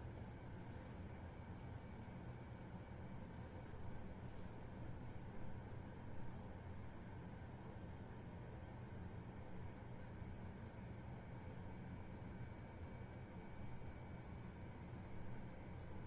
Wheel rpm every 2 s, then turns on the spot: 0, 0, 0, 0, 0, 0, 0, 0.
none